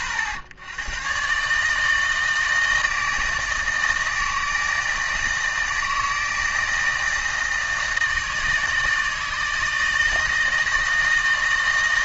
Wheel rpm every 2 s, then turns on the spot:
80, 160, 160, 160, 160, 160.
none